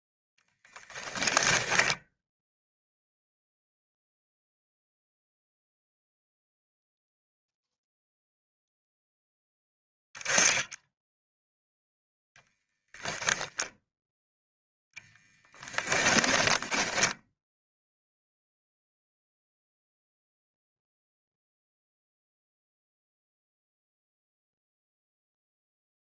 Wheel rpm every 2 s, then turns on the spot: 10, 0, 0, 0, 0, 10, 0, 10, 10, 0, 0, 0, 0.
14-18